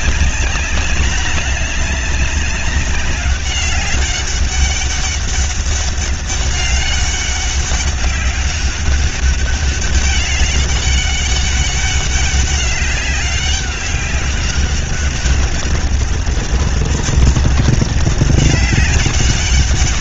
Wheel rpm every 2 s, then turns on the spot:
200, 200, 200, 200, 200, 200, 190, 200, 200, 200.
none